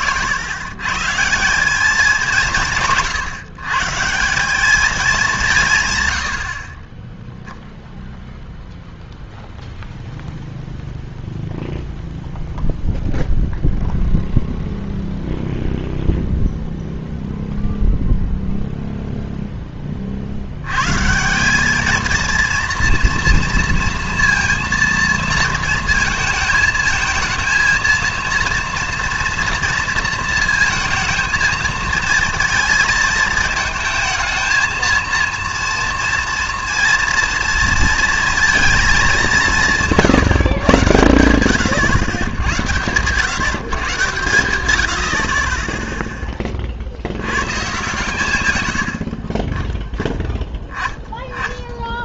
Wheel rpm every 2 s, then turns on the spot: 120, 170, 200, 50, 0, 0, 0, 0, 0, 0, 100, 230, 230, 220, 230, 230, 230, 220, 230, 230, 130, 100, 90, 30, 110, 10.
none